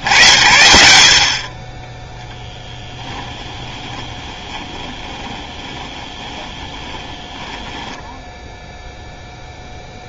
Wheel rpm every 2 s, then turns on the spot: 70, 10, 20, 20, 0.
4-8